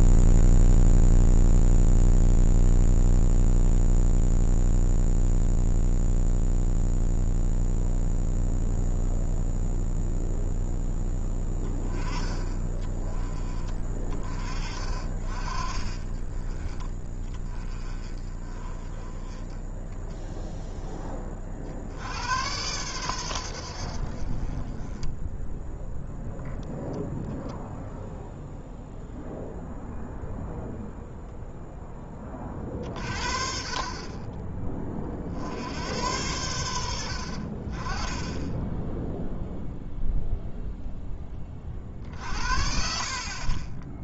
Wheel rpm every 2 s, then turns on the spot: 0, 0, 0, 0, 0, 0, 10, 20, 20, 20, 0, 100, 30, 20, 0, 0, 40, 30, 90, 10, 0, 60.
18-20